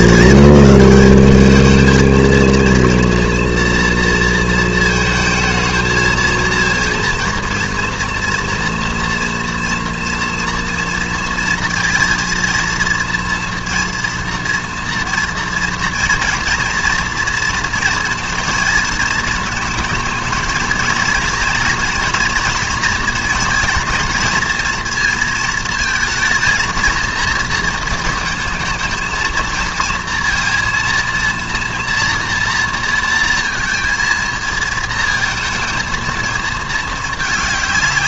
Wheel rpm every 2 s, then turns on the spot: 210, 230, 230, 220, 230, 230, 230, 230, 230, 230, 220, 230, 230, 220, 220, 230, 230, 230, 220.
none